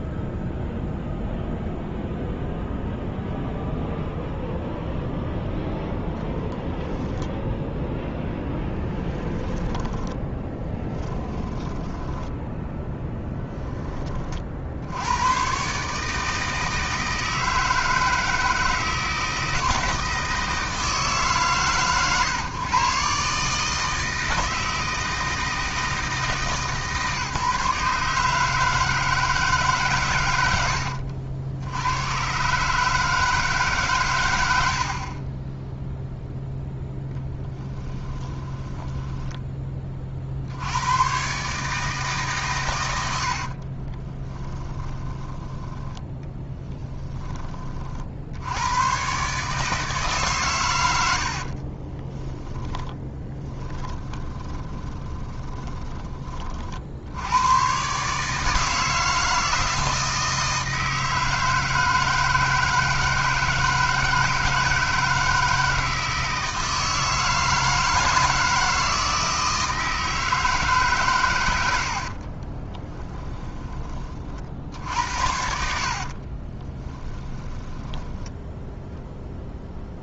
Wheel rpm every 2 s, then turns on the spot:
0, 0, 0, 10, 10, 10, 10, 70, 160, 160, 160, 140, 160, 150, 160, 90, 140, 60, 10, 10, 90, 110, 10, 20, 120, 100, 10, 20, 70, 160, 160, 160, 160, 160, 160, 140, 20, 60, 20, 0.
8-14 38-40 44-48 52-56 72-74 76-78